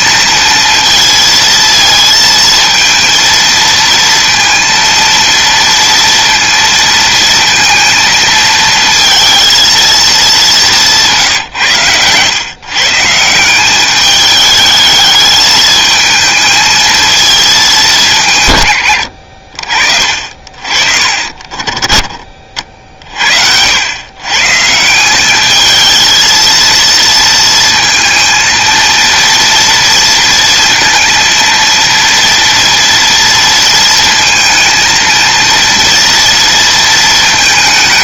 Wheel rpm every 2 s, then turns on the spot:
230, 230, 230, 220, 230, 150, 160, 220, 220, 60, 30, 50, 190, 230, 230, 230, 230, 230, 220.
none